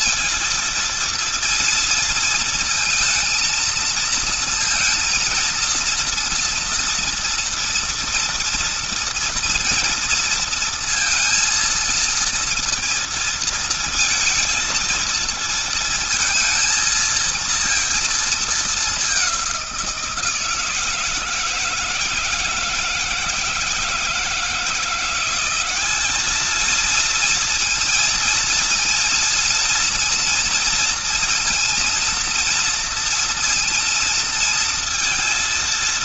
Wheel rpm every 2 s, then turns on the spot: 230, 230, 230, 230, 230, 230, 230, 230, 230, 210, 160, 160, 170, 220, 230, 230, 230, 220.
none